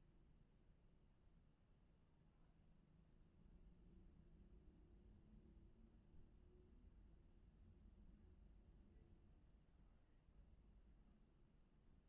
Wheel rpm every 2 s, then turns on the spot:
0, 0, 0, 0, 0, 0.
none